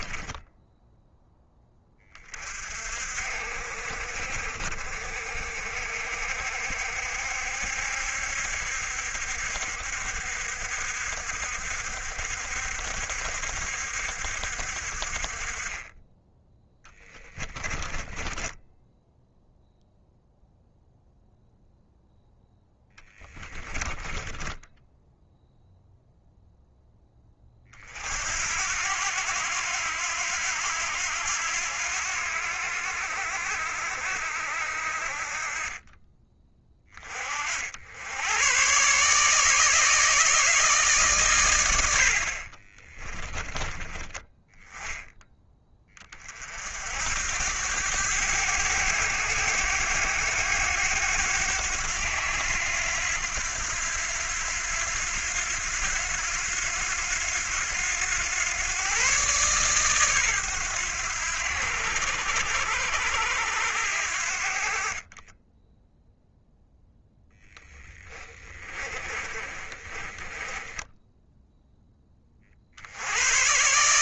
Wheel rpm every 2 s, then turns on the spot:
10, 40, 50, 60, 70, 70, 60, 50, 10, 10, 0, 10, 10, 10, 80, 80, 70, 50, 30, 130, 150, 20, 10, 70, 100, 100, 90, 90, 90, 120, 100, 80, 40, 0, 30, 20, 70.
0-2 16-20 22-26 42-44 68-72